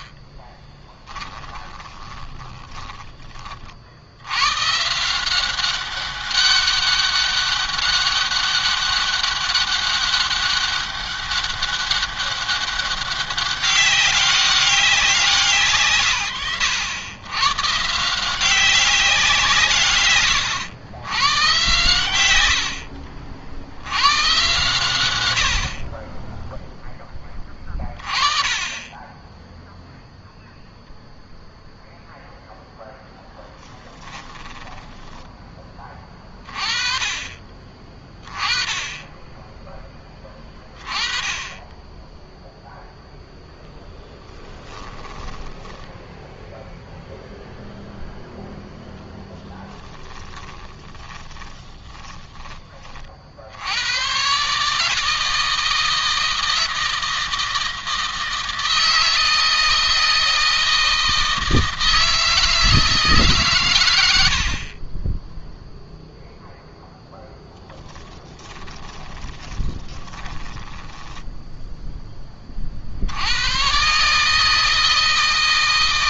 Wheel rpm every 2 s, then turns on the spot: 20, 20, 150, 200, 200, 200, 200, 190, 100, 190, 100, 80, 110, 10, 10, 0, 0, 10, 20, 10, 10, 0, 10, 0, 0, 20, 40, 150, 160, 160, 160, 160, 30, 0, 20, 10, 50, 160.
0-4 34-36 44-46 50-52 68-72